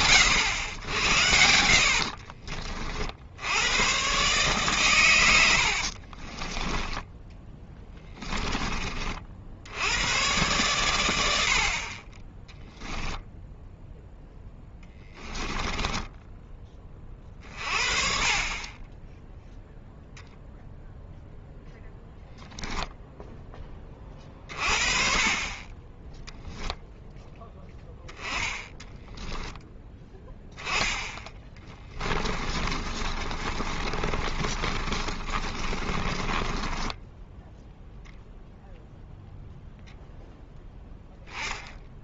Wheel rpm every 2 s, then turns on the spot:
90, 40, 130, 10, 20, 110, 0, 10, 20, 20, 0, 0, 30, 0, 10, 10, 30, 30, 10, 0, 0.
6-8 14-16 32-38